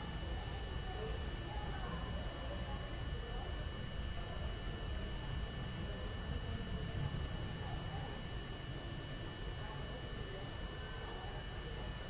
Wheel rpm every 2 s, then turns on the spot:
0, 0, 0, 0, 0, 0.
none